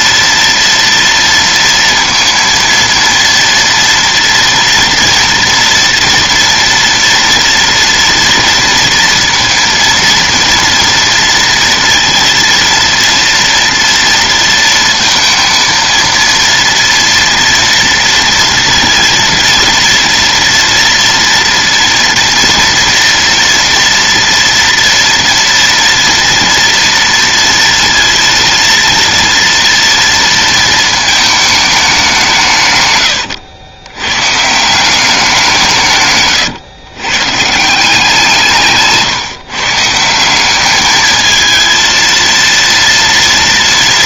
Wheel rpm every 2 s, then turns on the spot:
230, 230, 230, 230, 230, 230, 230, 230, 230, 230, 230, 230, 240, 230, 230, 230, 160, 150, 120, 160, 200, 230.
none